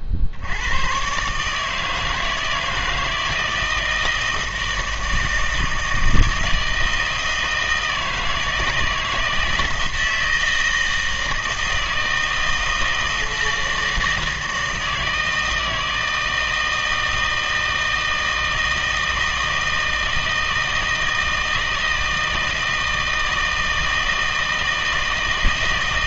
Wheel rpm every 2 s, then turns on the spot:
100, 160, 160, 160, 160, 160, 160, 160, 160, 160, 160, 160, 160.
none